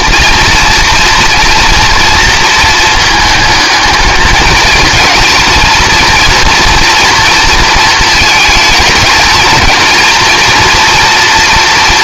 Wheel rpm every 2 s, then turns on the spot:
230, 230, 220, 230, 220, 230.
none